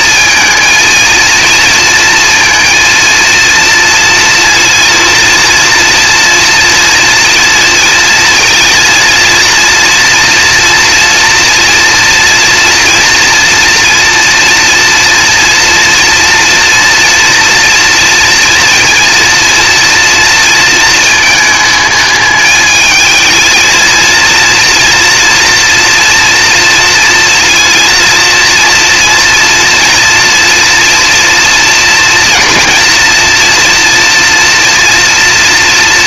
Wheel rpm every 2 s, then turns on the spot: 230, 230, 230, 230, 230, 230, 230, 240, 240, 230, 230, 220, 230, 240, 240, 240, 240, 240.
none